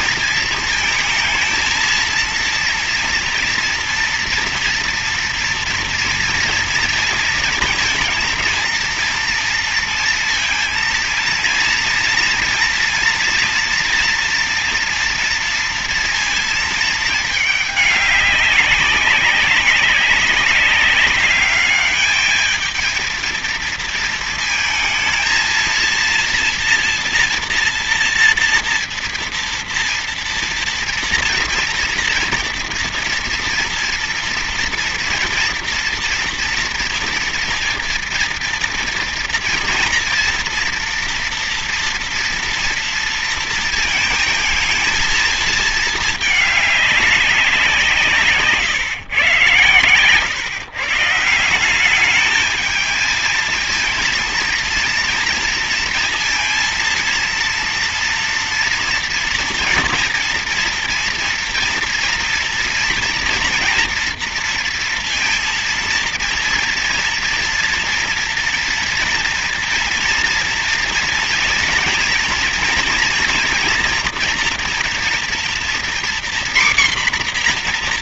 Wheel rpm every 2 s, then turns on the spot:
220, 230, 230, 230, 230, 230, 230, 240, 230, 190, 200, 220, 220, 230, 230, 230, 230, 230, 230, 230, 230, 230, 230, 210, 140, 130, 220, 230, 230, 230, 230, 230, 230, 230, 230, 230, 240, 240, 250.
none